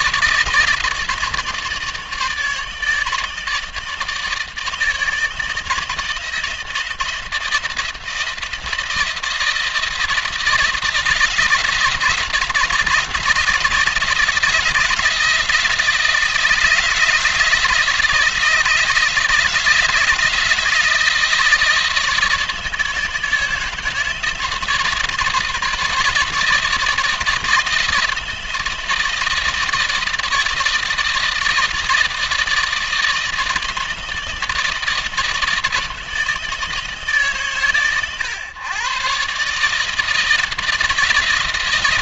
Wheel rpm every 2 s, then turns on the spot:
160, 160, 160, 170, 170, 170, 170, 160, 160, 160, 160, 160, 160, 160, 160, 160, 160, 160, 160, 130, 170.
none